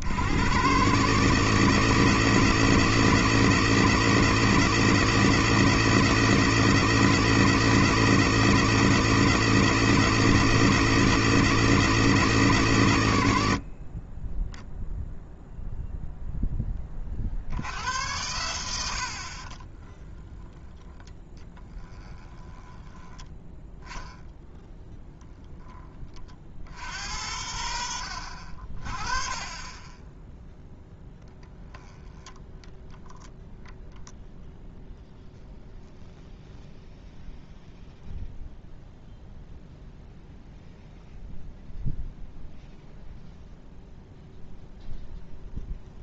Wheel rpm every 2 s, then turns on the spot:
140, 160, 160, 160, 160, 160, 140, 0, 10, 80, 10, 20, 10, 70, 50, 0, 10, 0, 0, 0, 0, 0, 0.
20-24